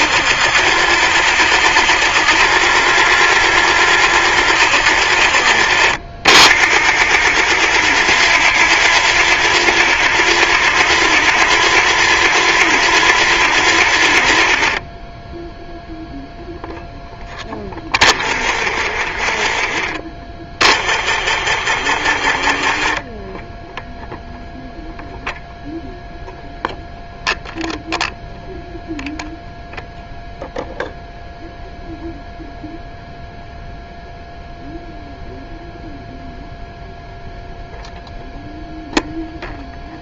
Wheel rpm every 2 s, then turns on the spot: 40, 40, 40, 40, 40, 40, 40, 20, 0, 20, 20, 10, 0, 0, 0, 0, 0, 0, 0, 0.
none